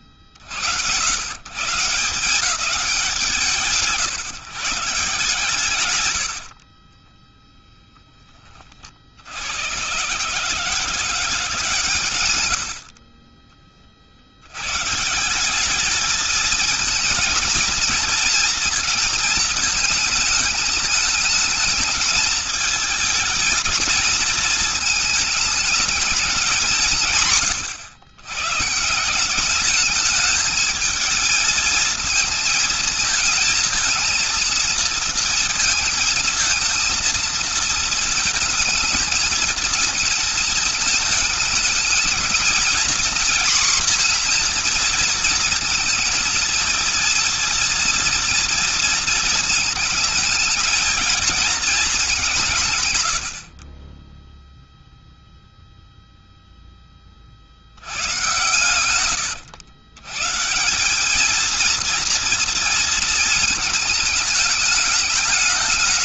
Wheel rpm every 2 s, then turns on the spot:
40, 170, 150, 100, 20, 150, 90, 90, 220, 230, 220, 220, 220, 190, 130, 210, 230, 230, 220, 220, 220, 220, 240, 230, 230, 230, 180, 0, 0, 120, 150, 230, 210.
6-8 52-54